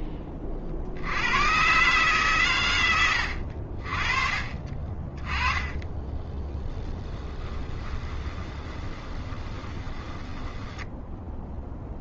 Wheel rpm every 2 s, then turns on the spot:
40, 80, 30, 20, 20, 10.
4-12